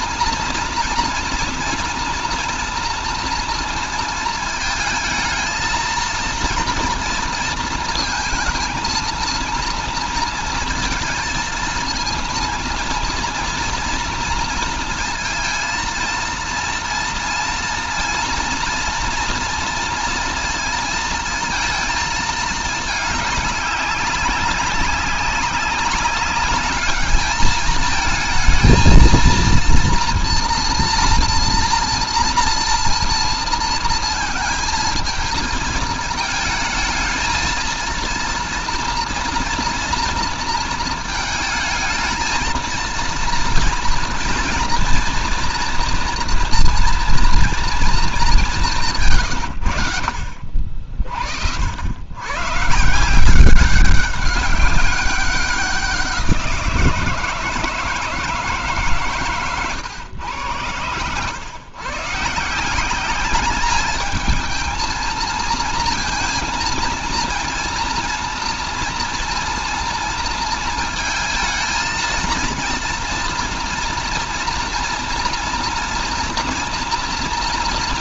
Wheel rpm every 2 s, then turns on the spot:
230, 230, 230, 230, 220, 230, 230, 230, 230, 230, 230, 220, 200, 200, 230, 230, 230, 220, 220, 240, 230, 230, 230, 240, 190, 50, 130, 190, 170, 160, 100, 160, 220, 230, 230, 230, 230, 230, 230.
none